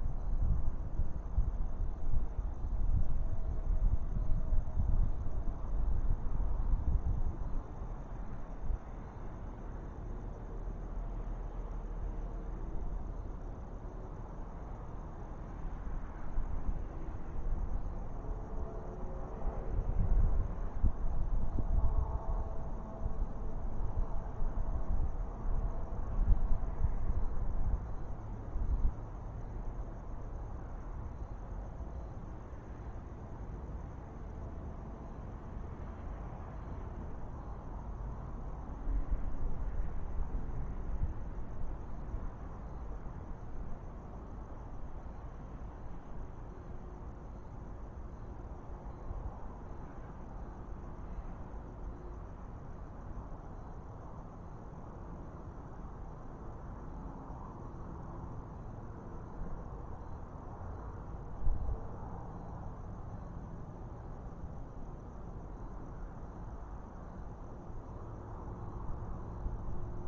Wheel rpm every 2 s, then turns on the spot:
0, 0, 0, 0, 0, 0, 0, 0, 0, 0, 0, 0, 0, 0, 0, 0, 0, 0, 0, 0, 0, 0, 0, 0, 0, 0, 0, 0, 0, 0, 0, 0, 0, 0, 0.
none